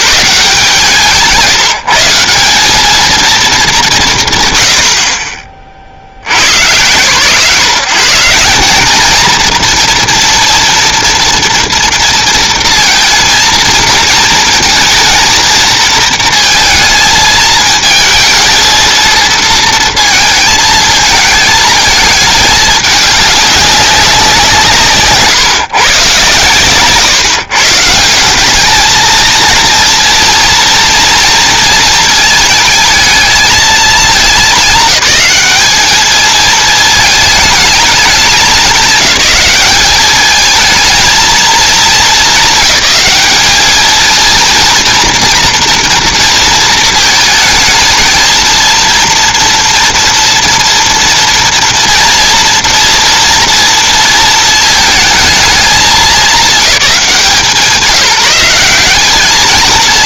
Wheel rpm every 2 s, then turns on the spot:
160, 190, 50, 70, 200, 240, 230, 230, 230, 230, 220, 210, 170, 130, 200, 230, 220, 210, 220, 190, 220, 220, 230, 220, 230, 230, 230, 220, 190, 180.
none